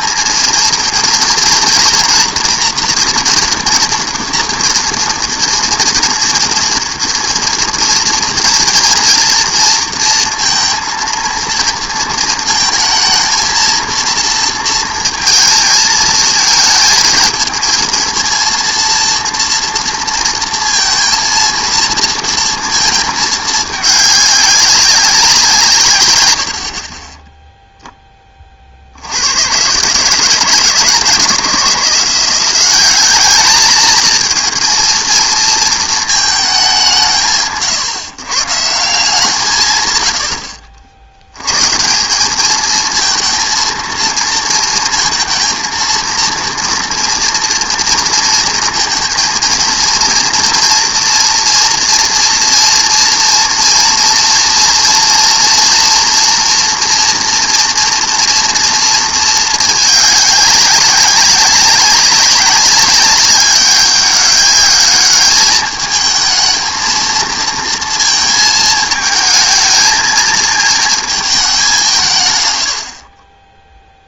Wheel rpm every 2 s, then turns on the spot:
230, 230, 240, 230, 230, 230, 220, 230, 220, 230, 230, 230, 200, 80, 30, 150, 190, 220, 210, 150, 70, 210, 230, 230, 230, 230, 230, 230, 230, 230, 200, 200, 200, 220, 220, 220, 110.
none